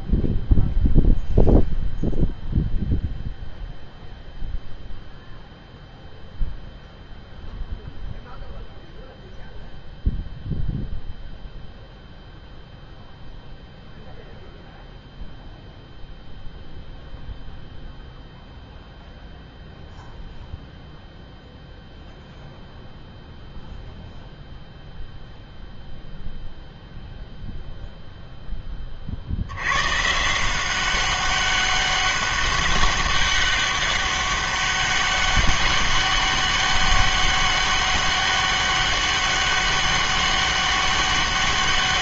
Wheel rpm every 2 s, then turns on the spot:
0, 0, 0, 0, 0, 0, 0, 0, 0, 0, 0, 0, 0, 0, 10, 180, 200, 200, 200, 200, 200.
none